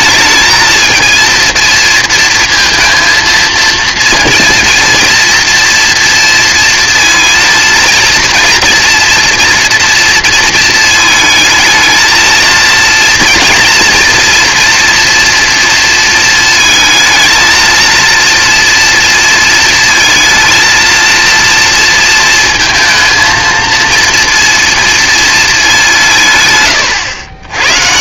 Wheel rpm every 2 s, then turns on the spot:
220, 230, 230, 230, 230, 230, 230, 240, 230, 230, 230, 230, 230, 130.
none